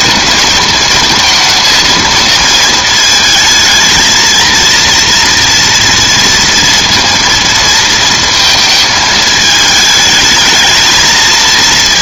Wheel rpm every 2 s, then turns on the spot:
230, 220, 230, 230, 220, 220.
none